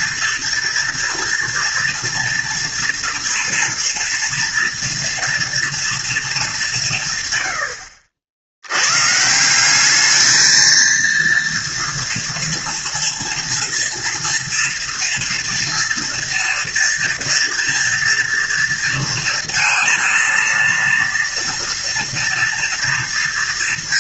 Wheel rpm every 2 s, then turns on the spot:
230, 230, 230, 190, 100, 230, 230, 230, 230, 230, 230, 230.
none